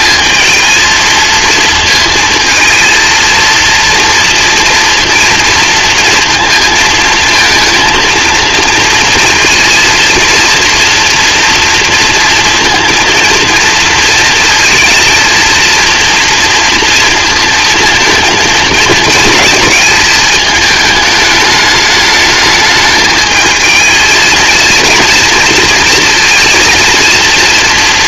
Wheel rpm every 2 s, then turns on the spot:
220, 230, 230, 230, 230, 240, 230, 230, 230, 230, 210, 220, 230, 230.
none